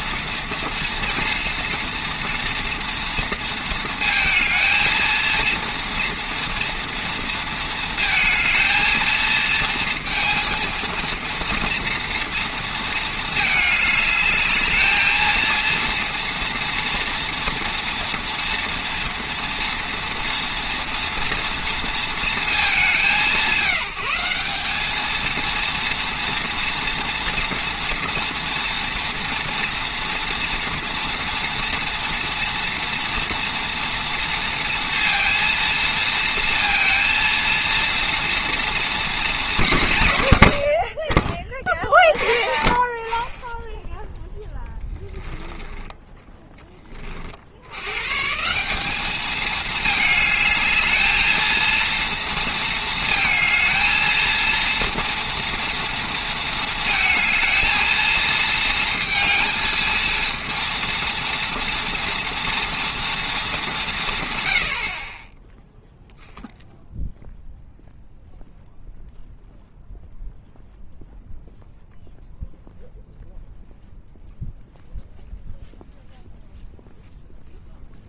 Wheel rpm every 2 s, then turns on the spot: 230, 230, 230, 230, 220, 230, 230, 220, 240, 230, 230, 200, 200, 230, 230, 230, 230, 230, 230, 230, 80, 30, 10, 20, 200, 220, 220, 230, 230, 230, 230, 230, 80, 0, 0, 0, 0, 0, 0.
none